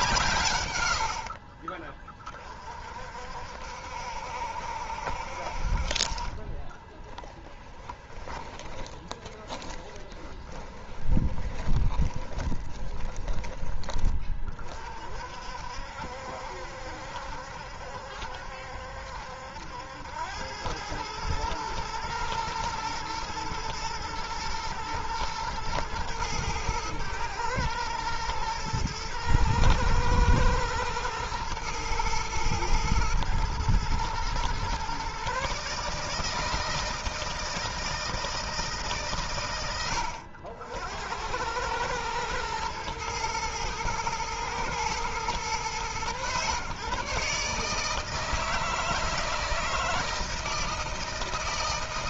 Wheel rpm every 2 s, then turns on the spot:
80, 50, 70, 20, 20, 20, 20, 40, 70, 70, 100, 120, 110, 110, 110, 110, 110, 130, 160, 150, 80, 110, 120, 130, 160, 160.
6-14